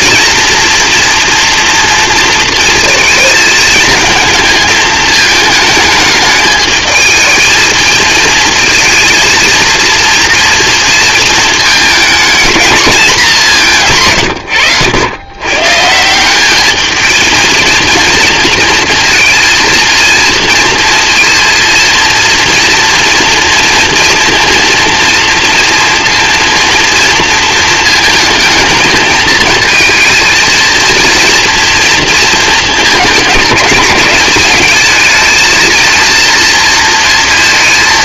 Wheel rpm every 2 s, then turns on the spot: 240, 230, 220, 220, 220, 230, 220, 100, 210, 230, 230, 230, 230, 230, 220, 230, 220, 210, 230.
none